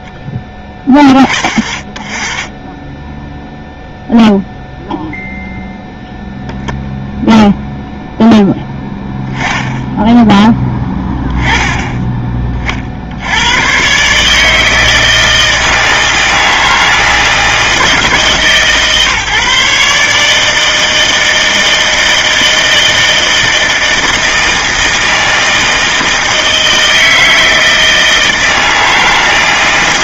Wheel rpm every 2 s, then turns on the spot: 40, 10, 0, 0, 10, 10, 60, 160, 160, 150, 160, 160, 160, 160, 160.
none